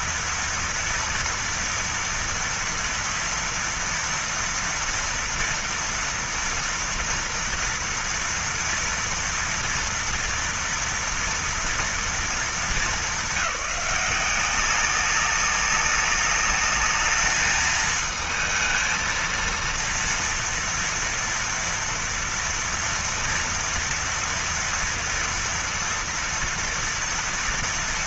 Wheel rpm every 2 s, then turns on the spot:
230, 230, 240, 240, 230, 230, 220, 190, 200, 220, 230, 230, 230, 230.
none